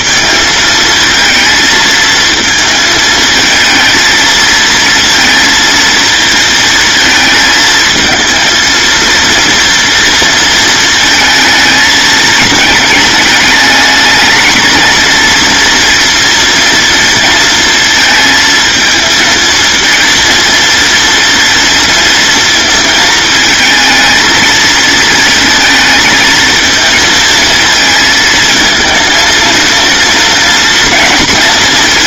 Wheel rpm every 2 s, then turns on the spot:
230, 220, 230, 220, 230, 220, 220, 220, 230, 220, 230, 230, 230, 230, 230, 230.
none